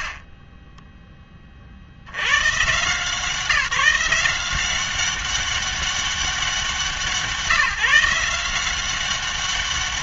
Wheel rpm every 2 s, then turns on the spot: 30, 140, 180, 180, 180.
none